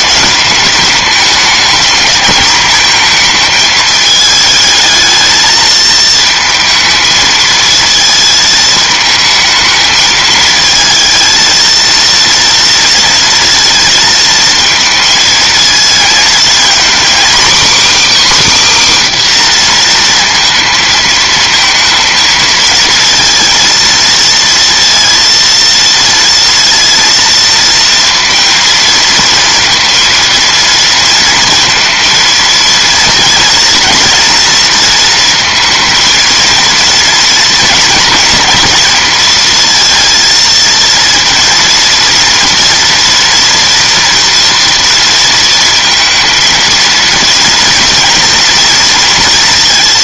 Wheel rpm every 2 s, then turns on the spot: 210, 220, 220, 220, 220, 220, 230, 230, 240, 290, 230, 220, 230, 230, 220, 220, 230, 230, 230, 230, 230, 240, 230, 230, 230.
none